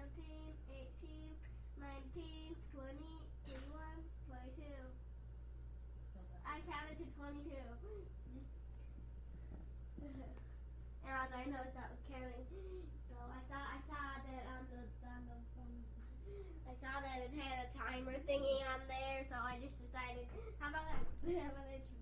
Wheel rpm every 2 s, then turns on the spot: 0, 0, 0, 0, 0, 0, 0, 0, 0, 0, 0.
none